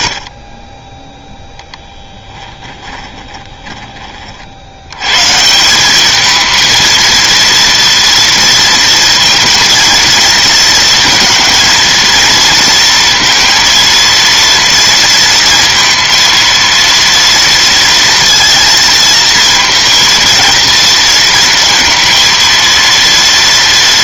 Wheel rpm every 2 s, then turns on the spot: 10, 20, 130, 230, 230, 230, 230, 230, 230, 230, 230, 230.
2-4